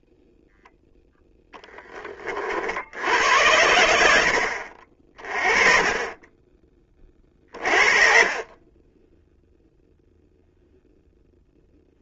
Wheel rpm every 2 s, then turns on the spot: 0, 70, 50, 40, 20, 0.
none